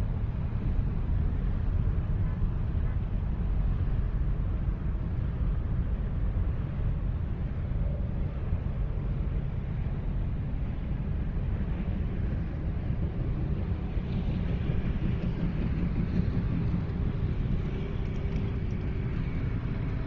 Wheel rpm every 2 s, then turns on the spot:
0, 0, 0, 0, 0, 0, 0, 0, 0, 0.
none